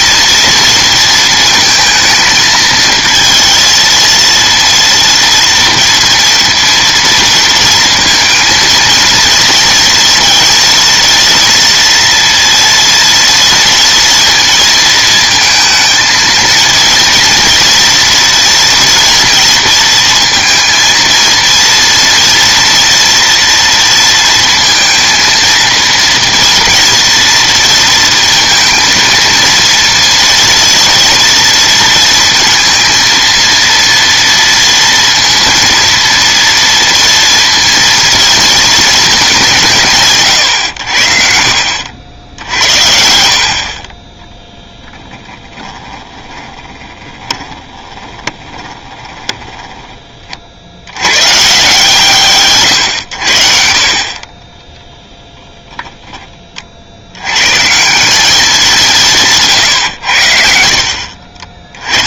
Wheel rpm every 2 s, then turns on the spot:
230, 220, 230, 230, 230, 230, 230, 230, 230, 230, 230, 230, 230, 230, 230, 230, 230, 230, 230, 220, 90, 70, 20, 20, 30, 70, 120, 20, 40, 190, 60.
46-50 54-56